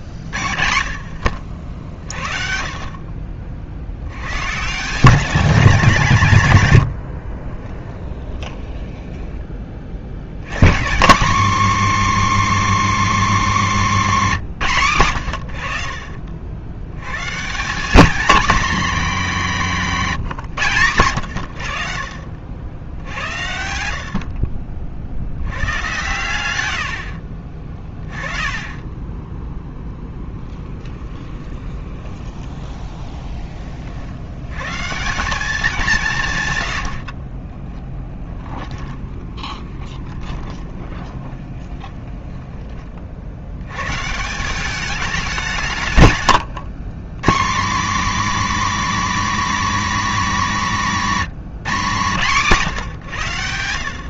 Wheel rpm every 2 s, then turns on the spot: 60, 50, 150, 110, 20, 150, 290, 170, 80, 250, 140, 80, 40, 80, 20, 10, 20, 130, 80, 20, 20, 30, 200, 130, 290, 240, 160.
8-10 30-34 38-42